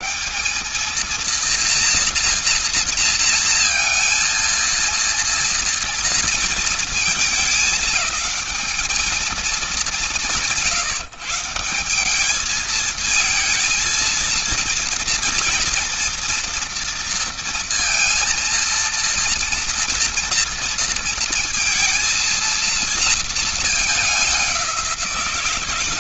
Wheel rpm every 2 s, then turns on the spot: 220, 230, 230, 230, 210, 160, 220, 230, 230, 230, 230, 230, 190.
none